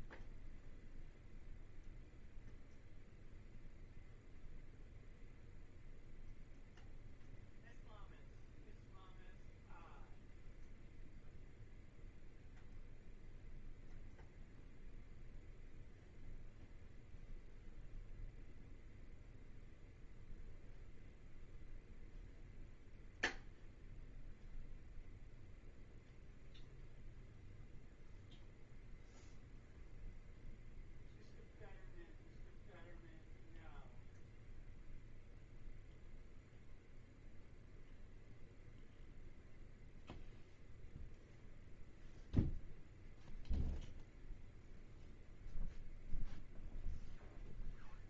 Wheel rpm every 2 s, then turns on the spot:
0, 0, 0, 0, 0, 0, 0, 0, 0, 0, 0, 0, 0, 0, 0, 0, 0, 0, 0, 0, 0, 0, 0, 0.
none